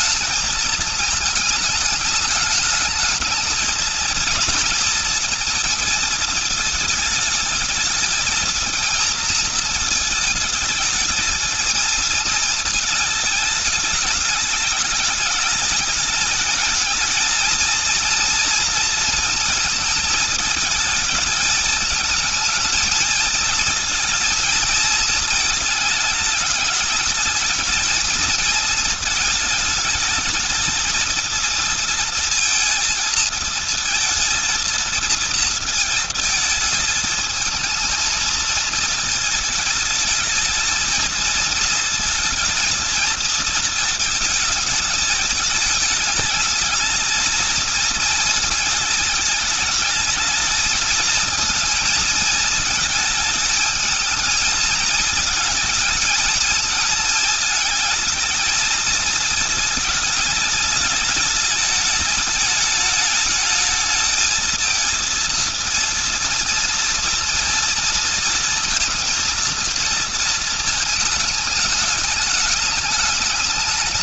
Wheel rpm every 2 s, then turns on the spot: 220, 210, 230, 220, 220, 220, 220, 200, 220, 230, 220, 220, 220, 220, 220, 220, 230, 230, 220, 220, 220, 220, 220, 220, 220, 220, 220, 220, 220, 220, 210, 210, 220, 230, 230, 220, 210.
none